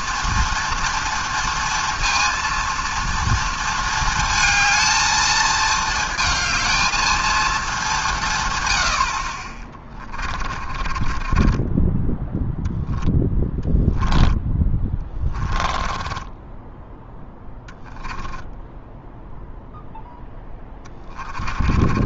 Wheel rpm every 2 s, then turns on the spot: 230, 230, 230, 220, 190, 20, 10, 10, 20, 10, 0.
10-20